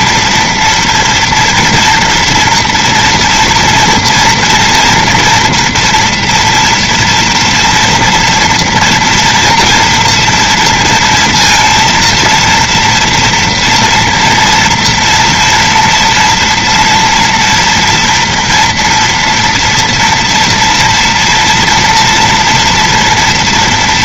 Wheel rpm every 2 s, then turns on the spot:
230, 230, 230, 230, 230, 230, 230, 240, 230, 230, 230, 240.
none